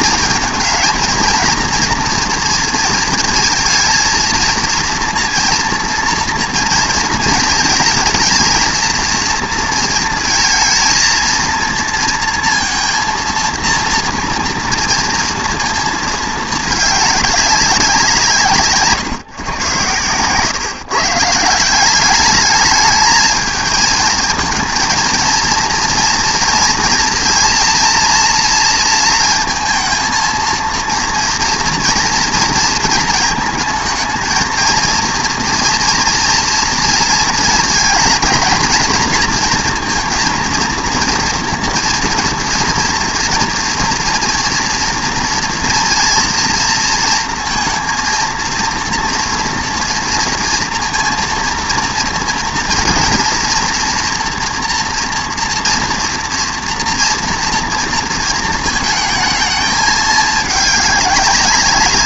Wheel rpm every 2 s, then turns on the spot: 220, 230, 230, 230, 230, 230, 230, 230, 220, 150, 130, 220, 220, 230, 230, 230, 230, 230, 230, 230, 230, 230, 230, 230, 230, 230, 230, 230, 230, 230, 210.
none